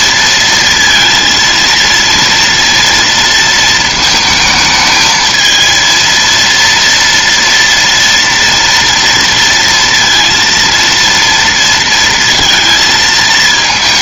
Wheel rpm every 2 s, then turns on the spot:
230, 230, 220, 230, 230, 230, 230.
none